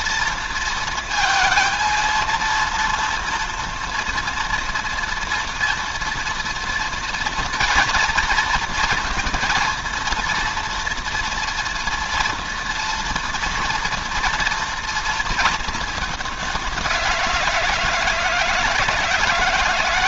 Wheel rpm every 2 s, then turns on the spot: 230, 230, 230, 230, 230, 230, 230, 230, 190, 160.
none